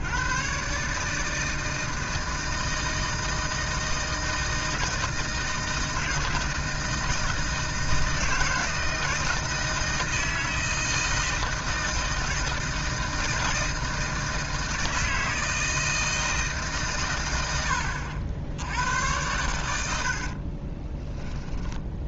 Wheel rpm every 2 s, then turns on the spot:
130, 160, 160, 160, 160, 160, 160, 160, 150, 80, 40.
20-22